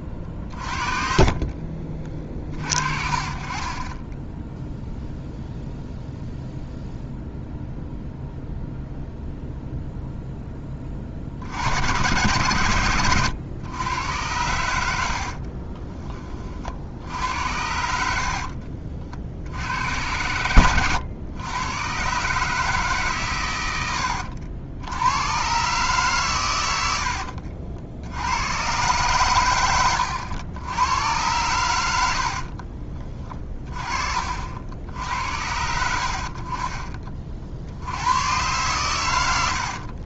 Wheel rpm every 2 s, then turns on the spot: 50, 50, 0, 0, 0, 30, 110, 80, 60, 50, 100, 150, 80, 80, 110, 90, 30, 70, 40, 120.
0-2 12-16 26-28